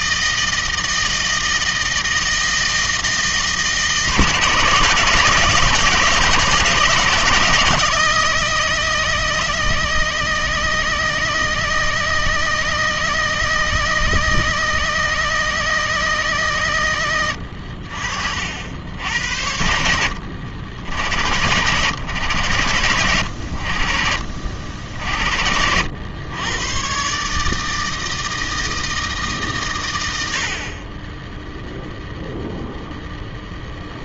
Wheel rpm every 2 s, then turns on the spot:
160, 160, 150, 140, 90, 80, 80, 80, 70, 70, 80, 100, 50, 100, 160, 90, 0.
none